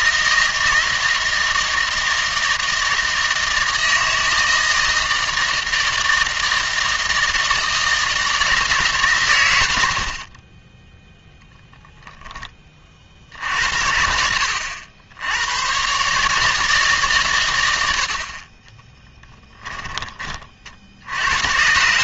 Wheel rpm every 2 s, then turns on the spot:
160, 160, 160, 160, 150, 10, 40, 80, 150, 20, 60.
18-20